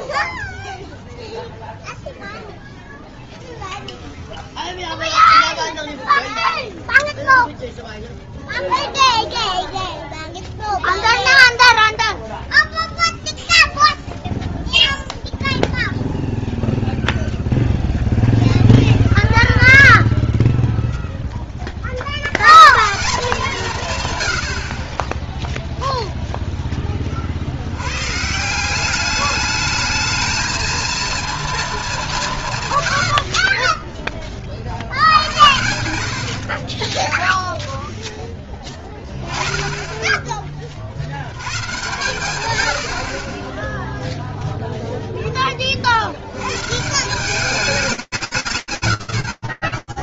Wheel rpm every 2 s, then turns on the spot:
0, 0, 0, 0, 10, 0, 0, 0, 0, 0, 0, 170, 30, 20, 190, 230, 110, 70, 30, 20, 40, 90, 0, 170, 70.
8-10 32-34 36-38 48-50